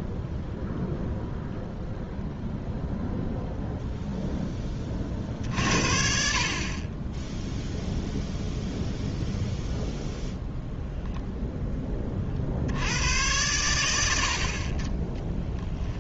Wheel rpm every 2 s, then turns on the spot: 0, 0, 10, 40, 0, 0, 60, 50.
none